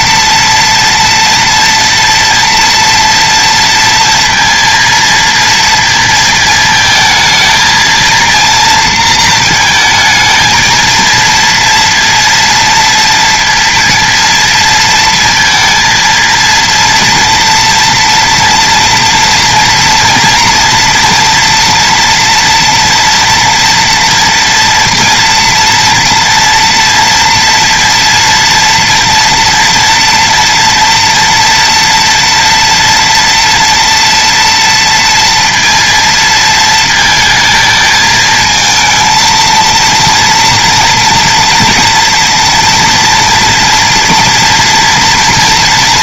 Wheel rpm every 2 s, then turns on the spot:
230, 230, 230, 230, 230, 220, 230, 230, 230, 240, 240, 240, 230, 230, 240, 230, 230, 230, 230, 220, 230, 230, 230.
none